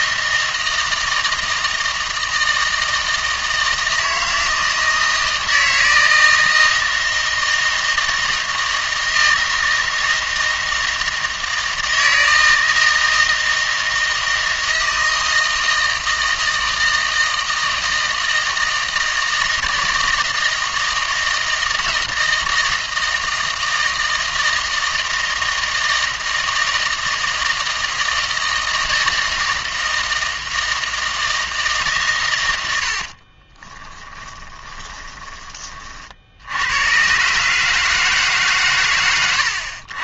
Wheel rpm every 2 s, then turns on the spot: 160, 160, 160, 160, 160, 160, 160, 160, 160, 160, 160, 160, 160, 160, 160, 160, 100, 20, 80, 140.
34-36